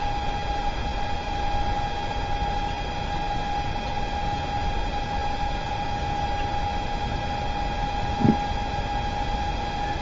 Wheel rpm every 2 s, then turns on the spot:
0, 0, 0, 0, 0.
none